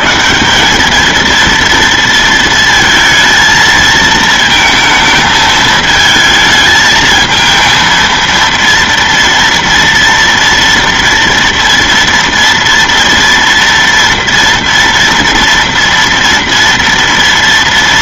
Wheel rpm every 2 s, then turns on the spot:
130, 230, 220, 220, 230, 230, 230, 230, 230.
none